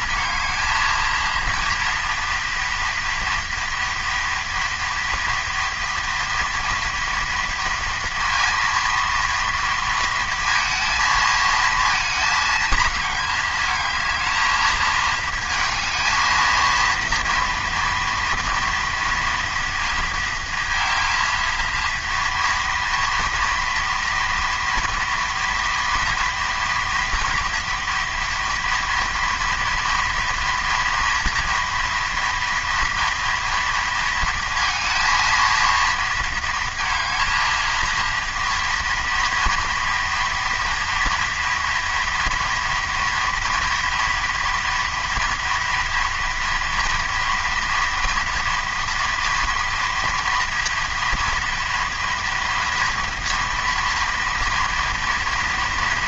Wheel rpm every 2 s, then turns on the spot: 230, 240, 230, 230, 230, 230, 210, 220, 230, 230, 230, 230, 230, 230, 230, 230, 230, 230, 230, 230, 230, 240, 230, 230, 230, 230, 230, 230.
none